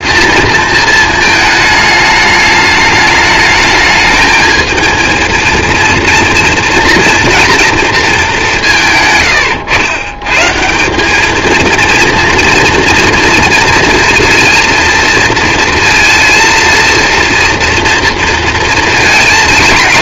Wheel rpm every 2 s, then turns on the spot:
230, 210, 230, 240, 170, 180, 230, 230, 230, 230.
none